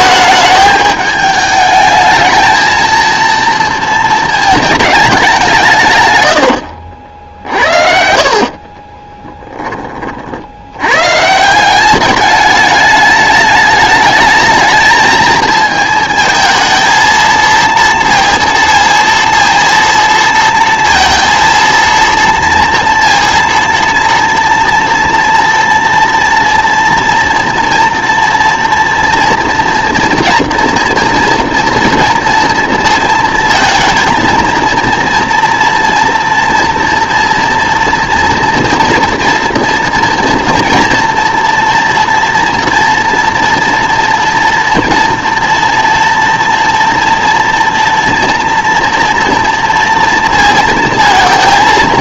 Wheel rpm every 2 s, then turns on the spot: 220, 230, 220, 70, 40, 80, 210, 220, 230, 230, 230, 230, 240, 230, 230, 230, 230, 230, 230, 230, 230, 240, 230, 230, 230, 230.
6-10